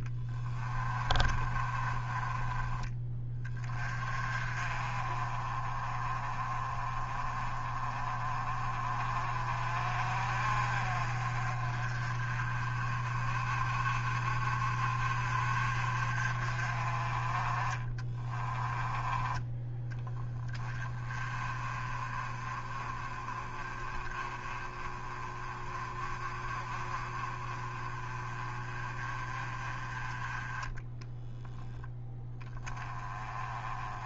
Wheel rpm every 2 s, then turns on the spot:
30, 20, 30, 30, 40, 40, 40, 40, 30, 20, 30, 30, 30, 30, 30, 10, 20.
0-2 30-32